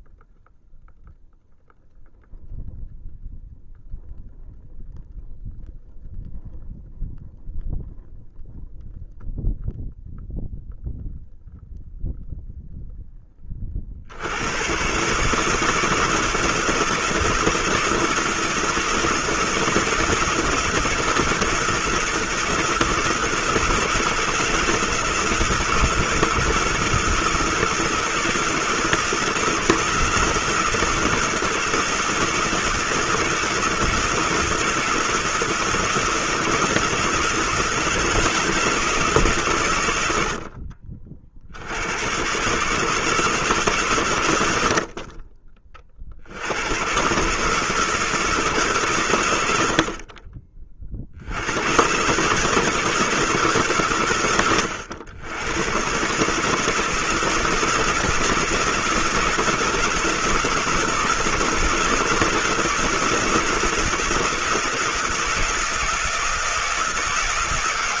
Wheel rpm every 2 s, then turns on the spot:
0, 0, 0, 0, 0, 0, 0, 120, 170, 160, 170, 160, 150, 160, 160, 160, 160, 160, 160, 170, 50, 150, 60, 110, 130, 40, 160, 100, 160, 170, 160, 160, 170, 160.
none